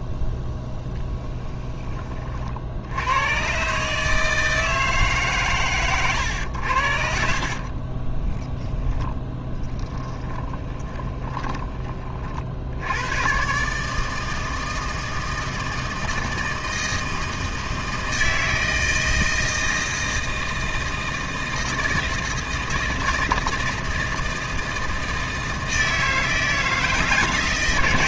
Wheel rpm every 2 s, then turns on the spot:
0, 60, 160, 80, 10, 20, 60, 160, 160, 160, 160, 160, 160, 160.
8-12